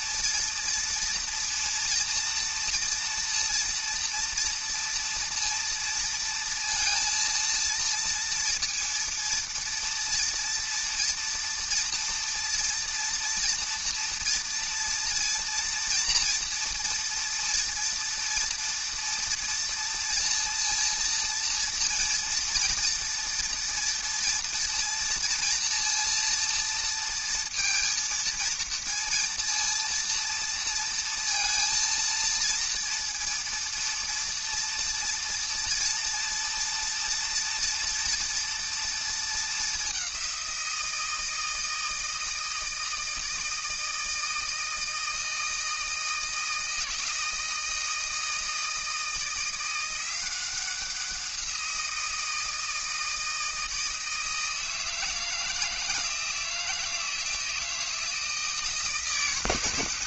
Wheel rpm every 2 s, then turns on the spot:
230, 230, 230, 230, 230, 230, 230, 230, 230, 230, 230, 230, 230, 230, 230, 230, 230, 230, 230, 230, 180, 160, 160, 160, 160, 180, 170, 160, 160, 160.
none